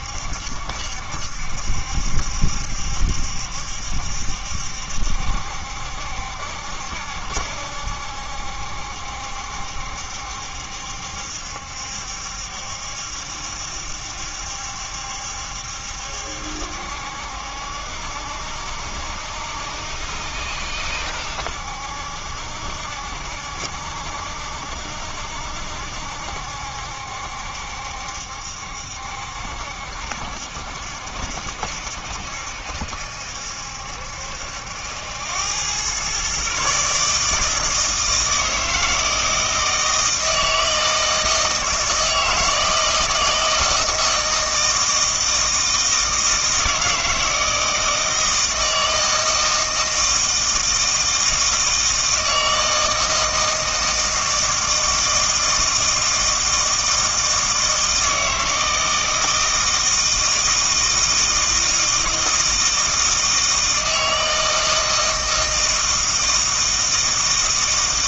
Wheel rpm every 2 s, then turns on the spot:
70, 70, 70, 70, 70, 70, 70, 70, 70, 70, 70, 70, 70, 70, 70, 70, 70, 80, 140, 160, 160, 160, 160, 160, 160, 160, 160, 160, 160, 160, 160, 160, 160, 160.
none